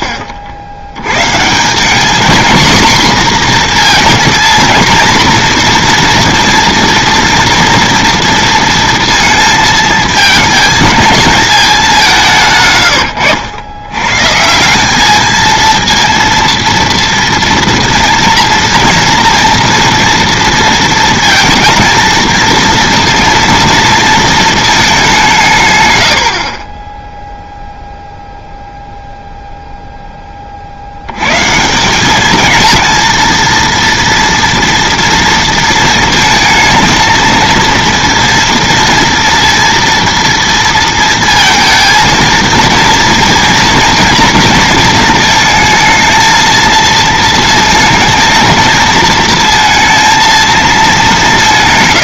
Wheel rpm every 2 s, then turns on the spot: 80, 230, 220, 230, 230, 220, 130, 180, 230, 230, 230, 230, 220, 30, 0, 50, 230, 230, 230, 230, 230, 230, 230, 230, 230, 220.
26-28